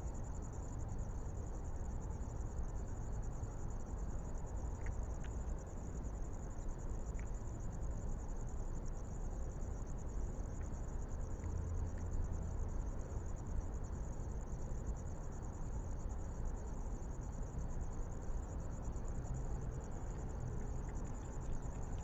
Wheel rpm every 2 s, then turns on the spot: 0, 0, 0, 0, 0, 0, 0, 0, 0, 0, 0.
none